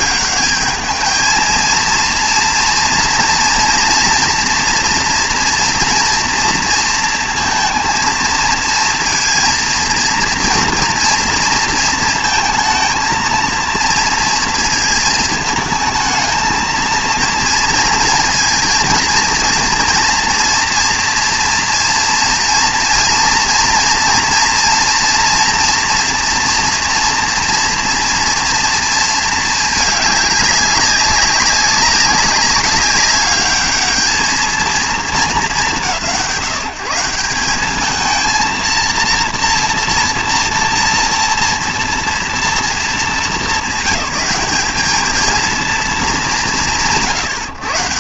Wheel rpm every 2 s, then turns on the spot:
210, 230, 230, 230, 230, 240, 220, 230, 220, 230, 240, 230, 230, 230, 230, 200, 200, 220, 160, 230, 230, 220, 210, 150.
none